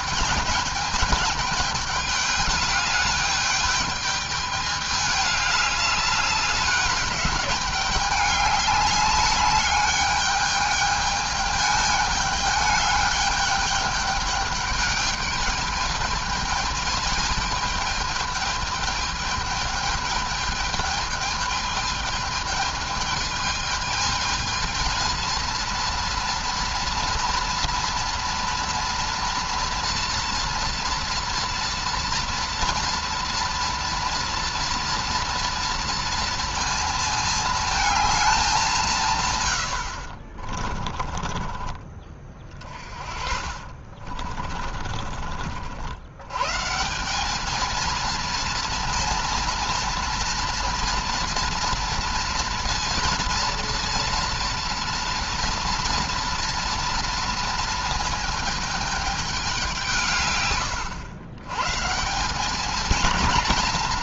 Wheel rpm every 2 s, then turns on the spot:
210, 200, 210, 200, 200, 210, 210, 210, 220, 220, 210, 210, 220, 230, 230, 230, 230, 230, 230, 170, 30, 40, 50, 150, 230, 230, 230, 230, 230, 220, 120, 210.
40-42 44-46